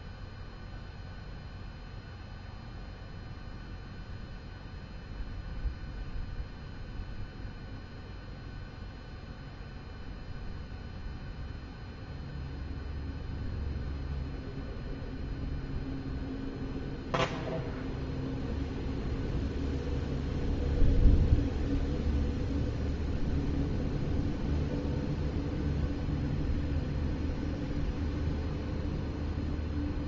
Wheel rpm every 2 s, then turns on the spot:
0, 0, 0, 0, 0, 0, 0, 0, 0, 0, 0, 0, 0, 0, 0.
none